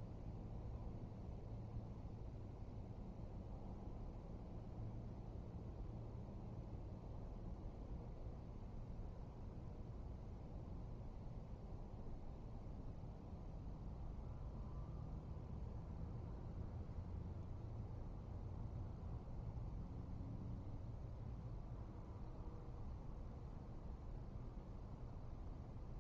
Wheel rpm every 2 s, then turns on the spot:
0, 0, 0, 0, 0, 0, 0, 0, 0, 0, 0, 0, 0.
none